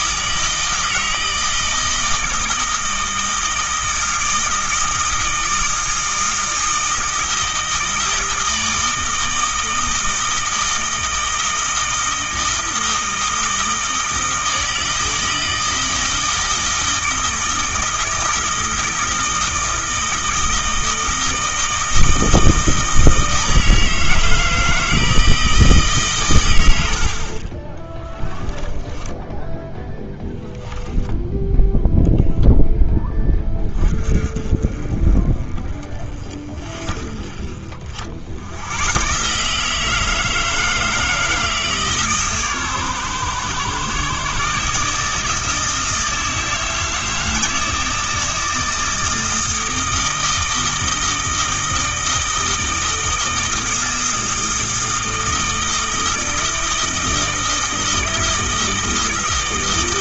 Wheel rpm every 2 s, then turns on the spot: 160, 160, 160, 160, 160, 160, 160, 160, 160, 160, 160, 160, 160, 60, 10, 10, 10, 30, 40, 120, 160, 120, 150, 160, 160, 160, 160, 160, 160, 160.
26-32